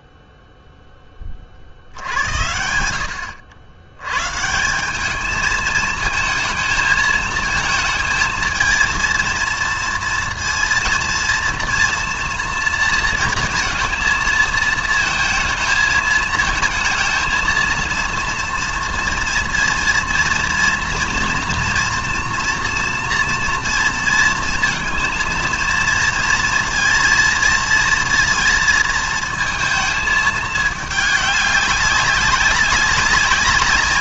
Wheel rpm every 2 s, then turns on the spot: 0, 80, 170, 220, 220, 230, 230, 220, 220, 230, 230, 240, 230, 230, 230, 210, 190.
none